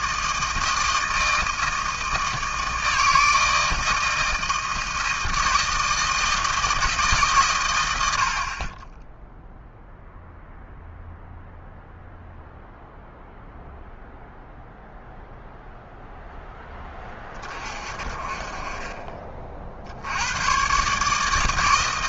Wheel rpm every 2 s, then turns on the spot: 160, 160, 160, 160, 40, 0, 0, 0, 10, 30, 110.
none